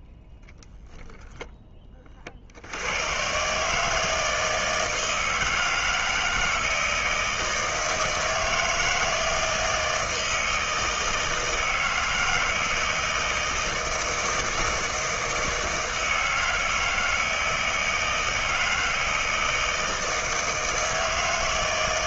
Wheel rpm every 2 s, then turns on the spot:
0, 70, 160, 160, 160, 160, 160, 160, 160, 160, 160.
none